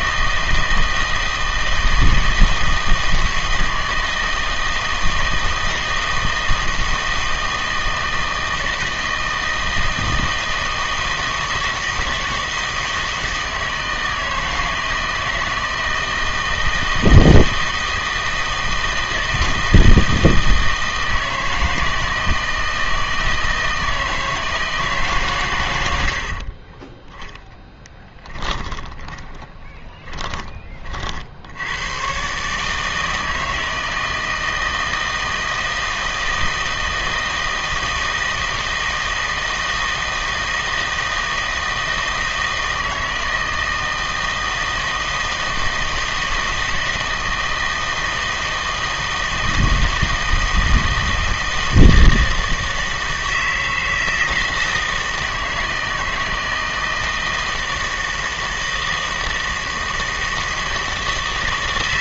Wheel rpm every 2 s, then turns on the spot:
160, 160, 160, 160, 160, 160, 160, 160, 160, 160, 160, 160, 160, 30, 10, 30, 150, 160, 160, 160, 160, 160, 160, 160, 160, 160, 160, 160, 160, 160, 160.
26-30